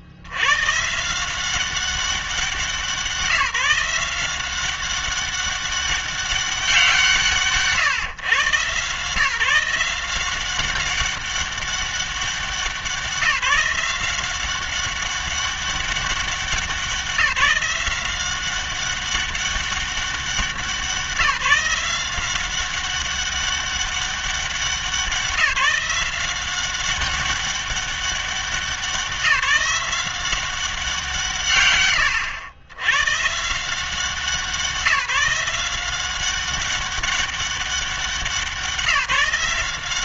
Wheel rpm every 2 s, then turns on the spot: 130, 190, 190, 190, 130, 190, 180, 190, 190, 190, 180, 190, 190, 190, 190, 190, 100, 170, 190, 170.
none